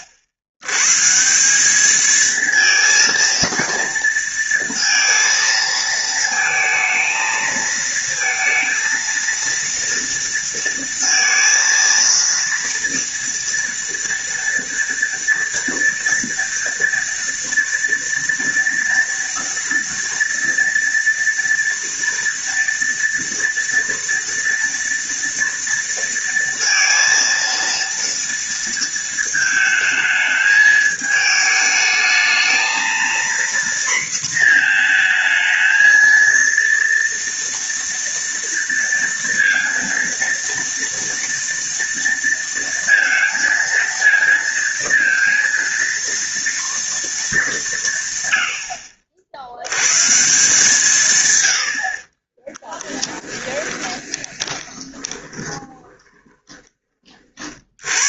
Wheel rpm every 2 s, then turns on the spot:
100, 230, 230, 220, 230, 230, 230, 230, 230, 230, 230, 230, 230, 230, 230, 220, 230, 230, 230, 230, 230, 230, 230, 230, 70, 140, 10, 20, 20.
52-56